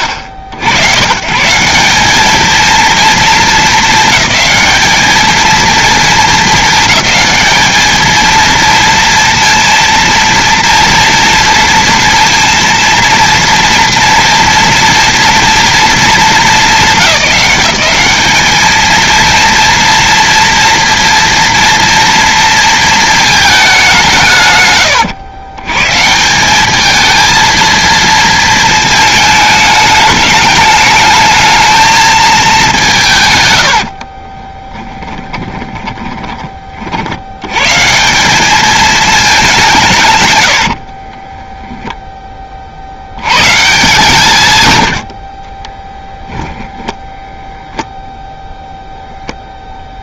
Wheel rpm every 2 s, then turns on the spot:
80, 220, 210, 220, 230, 230, 230, 230, 190, 220, 230, 230, 120, 210, 220, 210, 190, 20, 50, 210, 60, 50, 100, 10, 0.
34-36 40-42 46-48